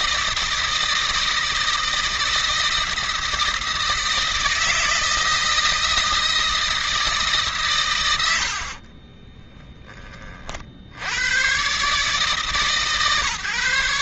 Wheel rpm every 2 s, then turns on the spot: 160, 160, 160, 160, 50, 60, 140.
8-10